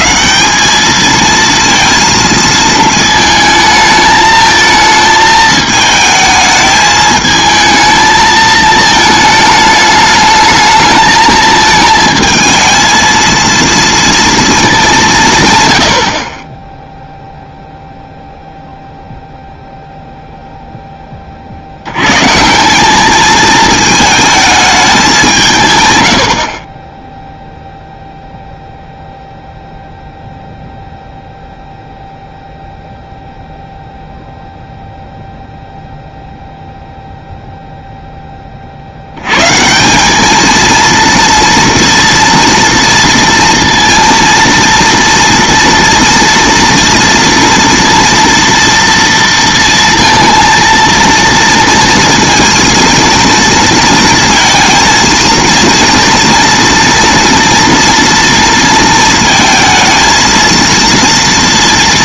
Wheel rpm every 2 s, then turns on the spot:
120, 230, 220, 220, 220, 210, 220, 230, 90, 0, 0, 150, 220, 70, 0, 0, 0, 0, 0, 20, 220, 230, 230, 230, 240, 230, 230, 230, 230, 230, 230.
none